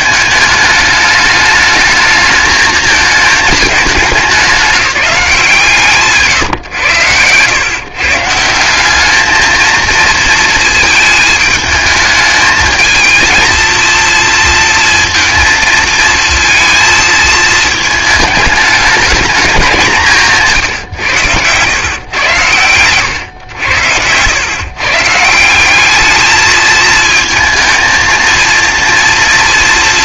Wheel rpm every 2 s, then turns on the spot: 210, 220, 200, 130, 180, 220, 220, 230, 220, 210, 160, 110, 130, 220, 230.
20-22